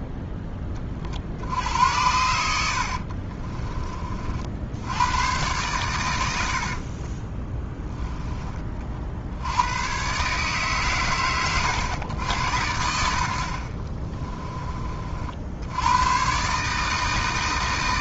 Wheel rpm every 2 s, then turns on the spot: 20, 60, 80, 50, 30, 100, 100, 30, 150.
2-4 6-8